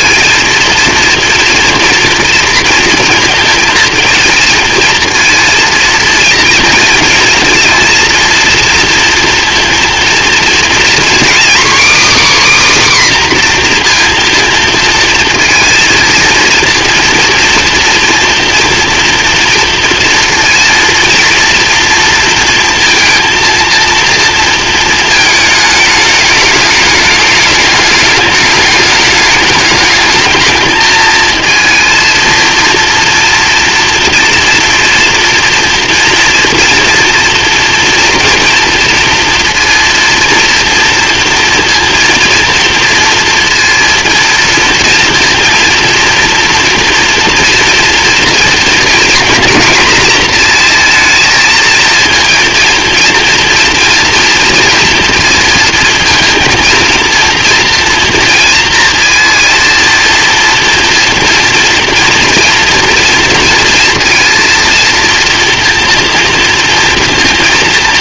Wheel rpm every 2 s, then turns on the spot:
230, 230, 230, 230, 230, 240, 280, 230, 230, 230, 230, 230, 220, 210, 210, 220, 230, 230, 230, 230, 230, 230, 230, 240, 230, 230, 230, 230, 220, 230, 230, 230, 230, 230.
none